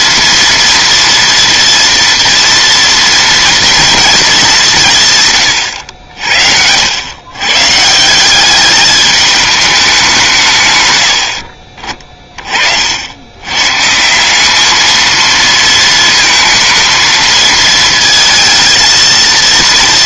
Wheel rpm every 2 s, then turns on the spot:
230, 230, 200, 70, 200, 140, 40, 200, 220, 230.
none